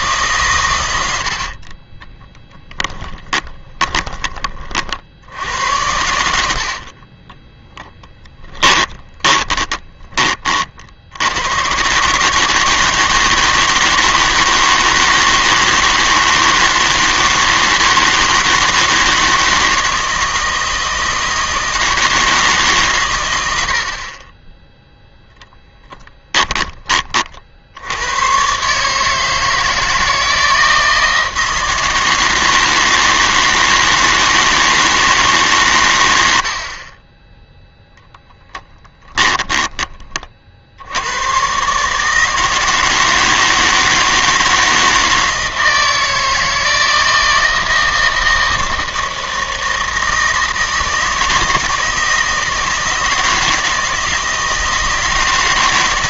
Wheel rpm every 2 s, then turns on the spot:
120, 10, 40, 70, 10, 40, 160, 160, 160, 160, 160, 140, 10, 20, 140, 160, 160, 160, 50, 20, 70, 160, 160, 160, 160, 160, 160, 160.
2-4 6-10 36-40